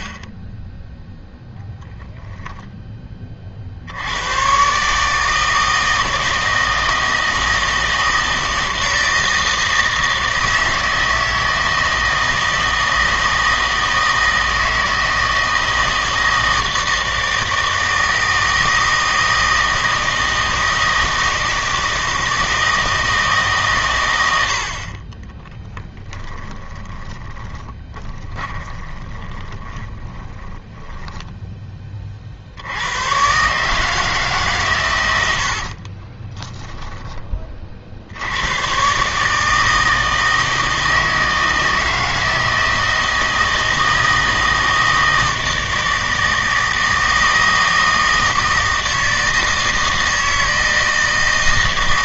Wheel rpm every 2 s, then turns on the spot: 10, 10, 130, 160, 160, 160, 160, 160, 160, 160, 160, 160, 70, 20, 20, 20, 80, 130, 10, 120, 160, 160, 160, 160, 160, 160.
26-32